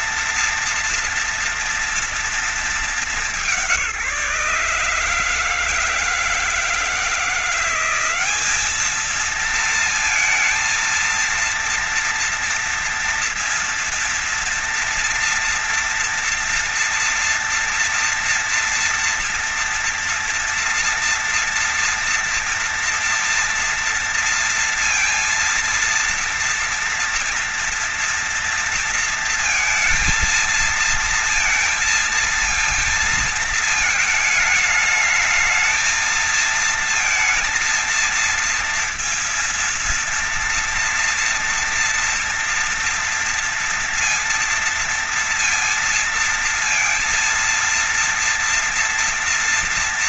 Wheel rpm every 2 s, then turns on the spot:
230, 210, 160, 170, 210, 230, 240, 230, 230, 240, 230, 240, 230, 230, 230, 230, 220, 220, 230, 230, 230, 230, 230, 230, 230.
none